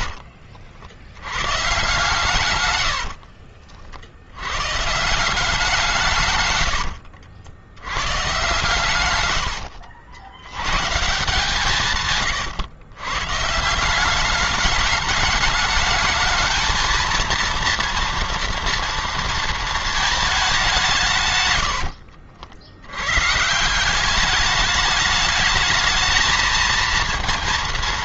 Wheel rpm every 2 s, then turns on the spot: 80, 110, 130, 110, 130, 120, 120, 210, 220, 230, 180, 90, 210, 230.
2-4 6-10